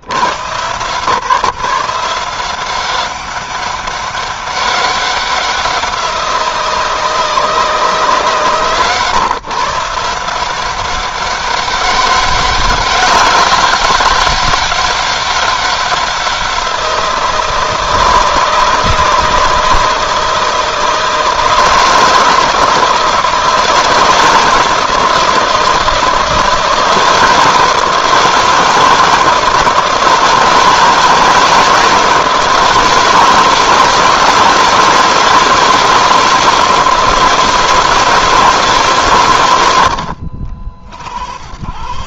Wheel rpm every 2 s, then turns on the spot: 140, 190, 190, 170, 140, 190, 200, 200, 170, 160, 160, 160, 160, 160, 160, 160, 160, 160, 160, 140, 70.
none